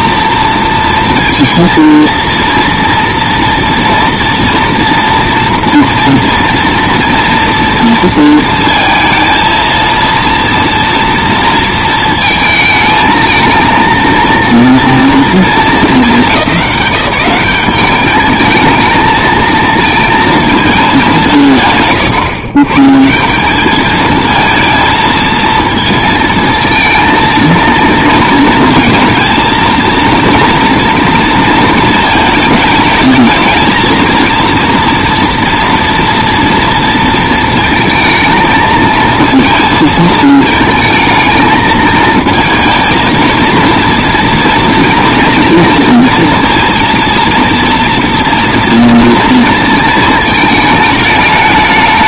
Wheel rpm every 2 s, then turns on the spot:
230, 230, 230, 240, 230, 230, 220, 230, 190, 220, 170, 170, 230, 230, 220, 230, 220, 230, 230, 230, 220, 230, 230, 230, 230, 210.
none